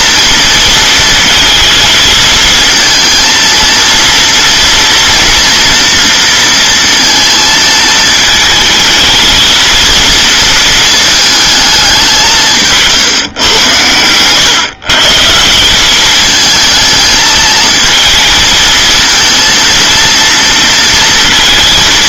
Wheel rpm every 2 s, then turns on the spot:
230, 230, 240, 230, 220, 220, 150, 140, 220, 220, 230.
none